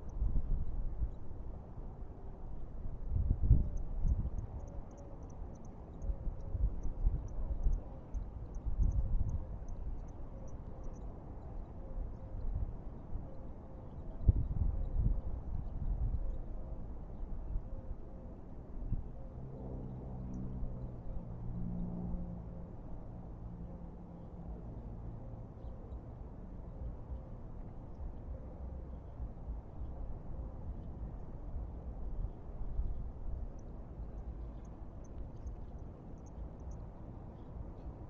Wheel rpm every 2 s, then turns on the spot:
0, 0, 0, 0, 0, 0, 0, 0, 0, 0, 0, 0, 0, 0, 0, 0, 0, 0, 0.
none